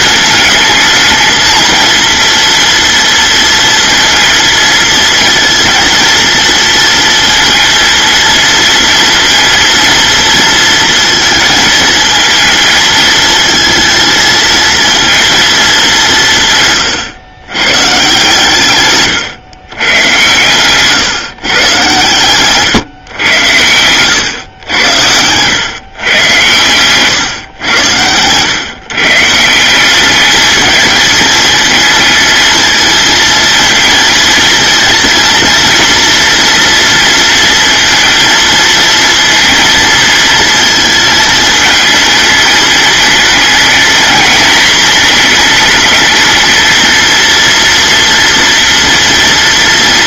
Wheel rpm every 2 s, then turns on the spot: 220, 230, 230, 230, 230, 230, 220, 230, 140, 120, 130, 130, 100, 120, 130, 220, 220, 220, 240, 230, 220, 220, 220, 220, 230.
none